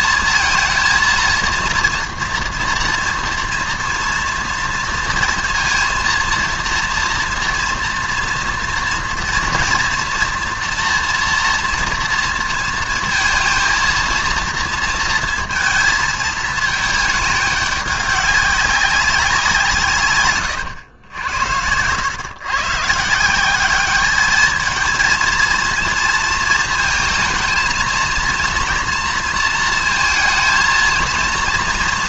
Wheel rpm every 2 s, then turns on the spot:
230, 230, 230, 230, 230, 240, 230, 230, 210, 200, 110, 150, 220, 230, 230, 230.
none